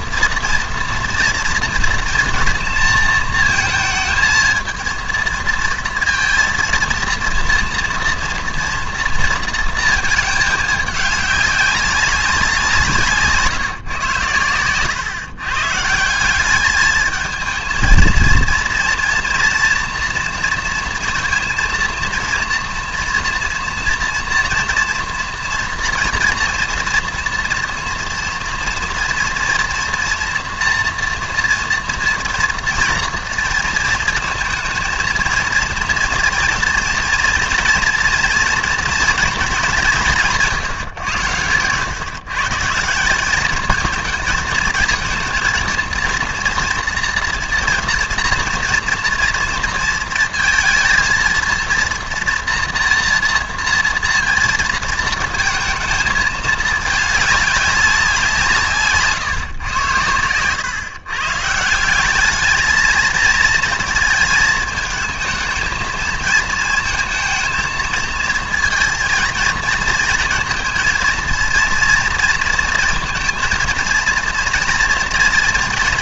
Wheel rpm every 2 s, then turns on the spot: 230, 230, 220, 230, 230, 210, 170, 110, 200, 230, 230, 230, 230, 230, 240, 230, 230, 230, 230, 240, 160, 150, 220, 230, 240, 230, 230, 230, 220, 150, 110, 220, 220, 220, 230, 230, 230, 230.
none